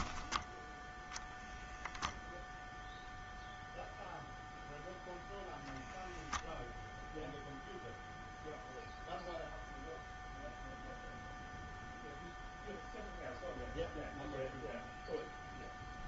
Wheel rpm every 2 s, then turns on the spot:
0, 0, 0, 0, 0, 0, 0, 0.
none